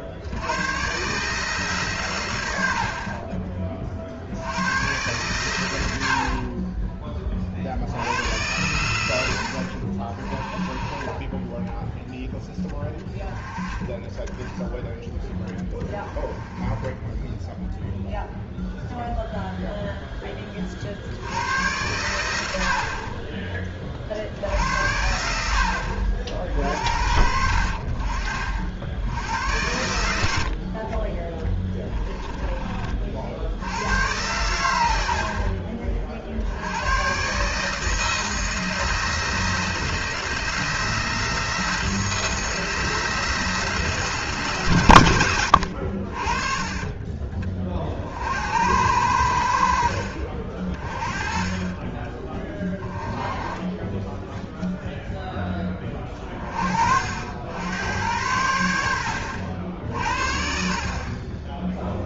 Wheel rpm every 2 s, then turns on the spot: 110, 70, 100, 20, 100, 20, 10, 10, 10, 0, 40, 50, 70, 60, 70, 40, 40, 80, 90, 160, 160, 160, 120, 30, 80, 40, 20, 0, 50, 80, 40.
46-48 58-60